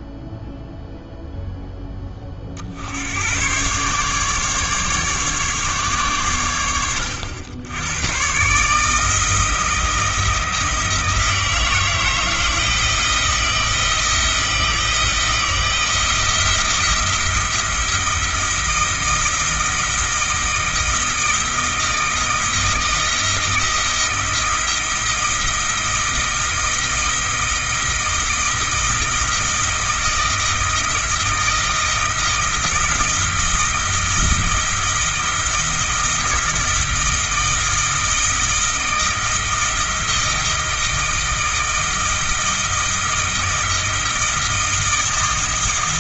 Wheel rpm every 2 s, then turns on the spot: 0, 80, 140, 90, 150, 160, 170, 160, 170, 170, 160, 160, 160, 160, 160, 160, 160, 160, 160, 160, 160, 160, 160.
none